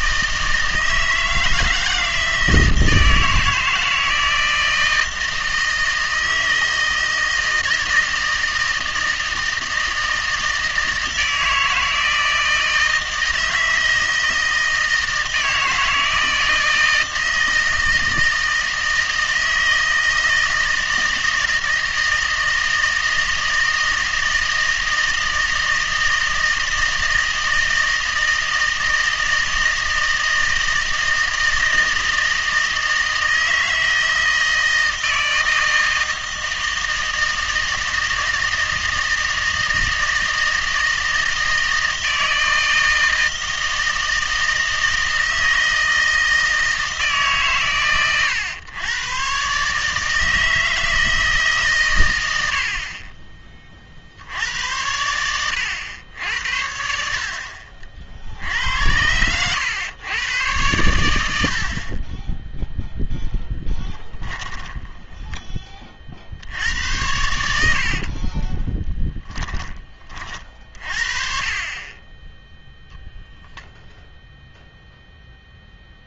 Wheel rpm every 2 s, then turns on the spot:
160, 160, 160, 160, 160, 160, 160, 160, 160, 160, 160, 160, 160, 160, 160, 160, 160, 160, 160, 160, 160, 160, 160, 160, 100, 160, 70, 80, 70, 80, 110, 0, 10, 80, 20, 40, 0, 0.
64-66 68-70